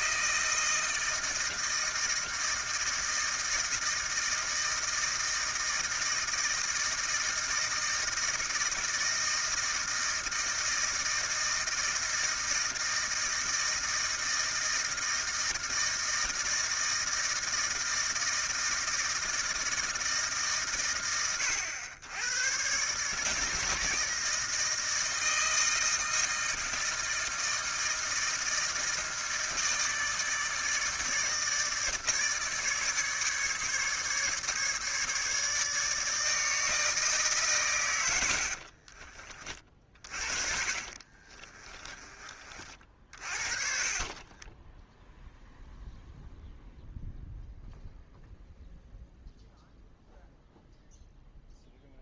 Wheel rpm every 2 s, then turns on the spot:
160, 160, 160, 160, 160, 160, 160, 160, 160, 160, 100, 110, 160, 160, 160, 160, 150, 150, 160, 60, 50, 30, 20, 0, 0, 0.
38-42 44-46